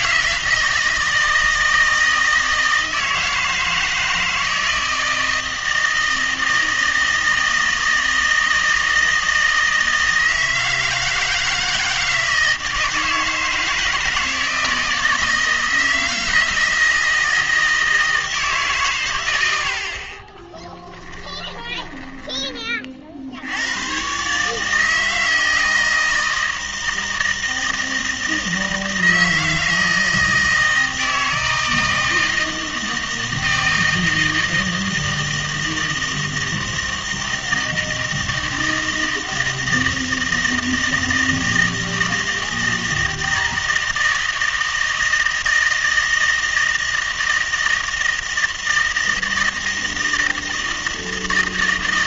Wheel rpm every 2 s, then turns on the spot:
160, 160, 160, 160, 160, 160, 160, 160, 160, 140, 10, 20, 150, 160, 160, 160, 160, 160, 160, 160, 160, 160, 160, 160, 160, 160.
20-22